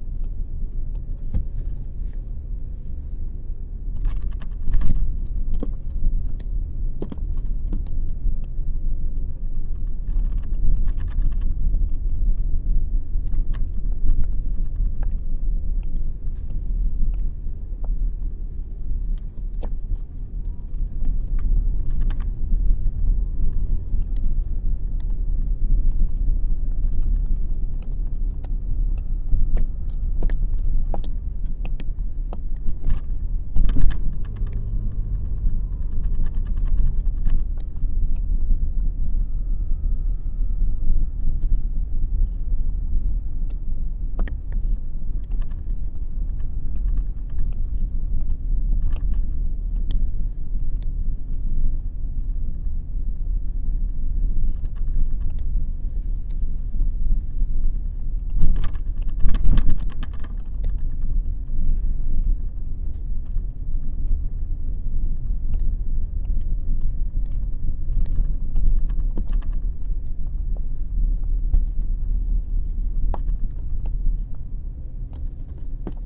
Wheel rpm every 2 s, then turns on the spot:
0, 0, 0, 0, 0, 0, 0, 0, 0, 0, 0, 0, 0, 0, 0, 0, 0, 0, 0, 0, 0, 0, 0, 0, 0, 0, 0, 0, 0, 0, 0, 0, 0, 0, 0, 0, 0, 0.
none